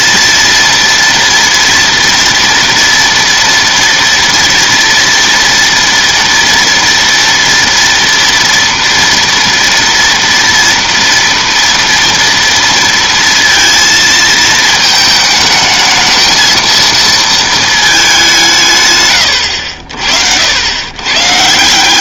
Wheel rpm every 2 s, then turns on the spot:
230, 230, 230, 230, 230, 230, 230, 220, 220, 190, 70.
none